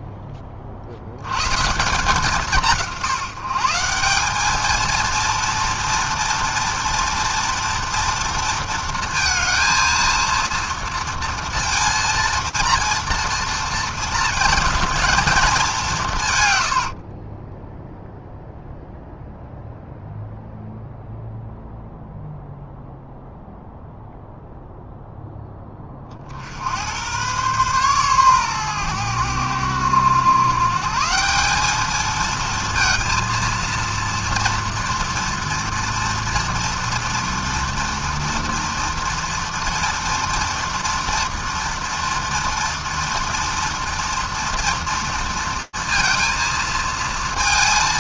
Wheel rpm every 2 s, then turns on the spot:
30, 170, 210, 230, 230, 230, 230, 220, 120, 0, 0, 0, 0, 60, 120, 120, 230, 230, 230, 230, 230, 230, 230, 230.
16-18